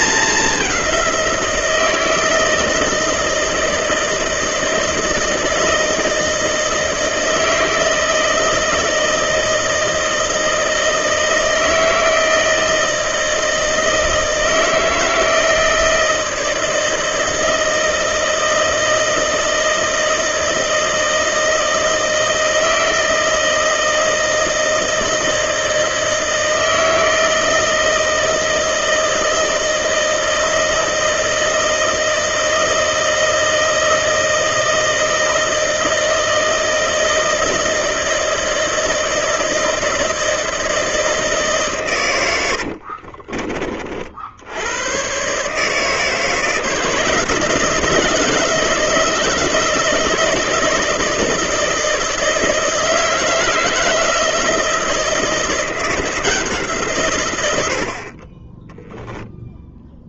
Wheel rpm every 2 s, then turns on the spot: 200, 160, 160, 160, 160, 160, 160, 160, 160, 160, 160, 160, 160, 160, 160, 160, 160, 160, 160, 160, 160, 80, 90, 160, 160, 160, 160, 160, 160, 20.
42-44